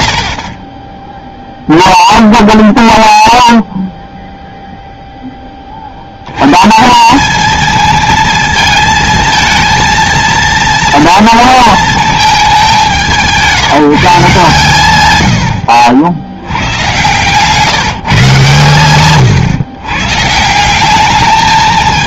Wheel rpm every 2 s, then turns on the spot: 20, 0, 0, 160, 220, 230, 190, 120, 100, 130, 190.
0-2 16-18